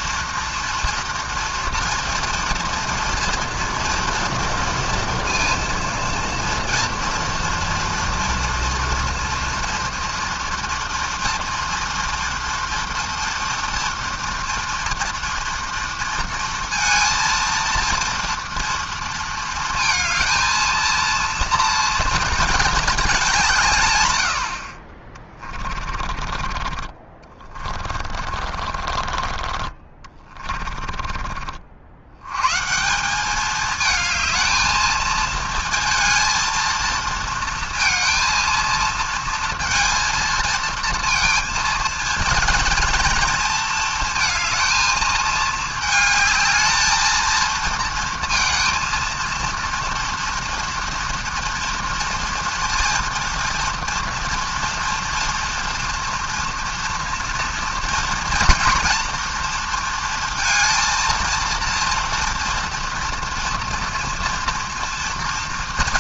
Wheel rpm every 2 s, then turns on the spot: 230, 230, 230, 230, 230, 240, 230, 230, 230, 230, 230, 220, 60, 30, 40, 30, 130, 220, 230, 230, 230, 230, 220, 220, 230, 230, 230, 230, 230, 230, 230, 230, 230.
28-32